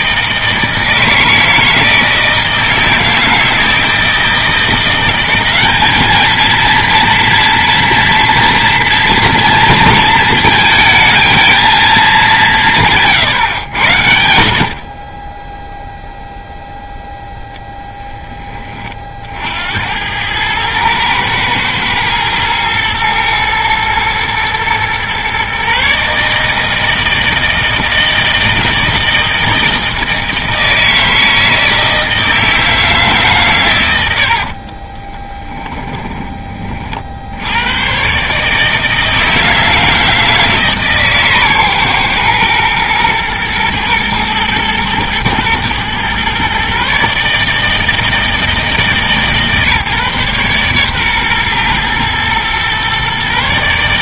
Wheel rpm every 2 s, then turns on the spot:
160, 160, 170, 230, 230, 220, 170, 40, 0, 30, 110, 110, 120, 160, 160, 160, 160, 30, 40, 160, 150, 120, 110, 140, 150, 130, 120.
12-14 34-36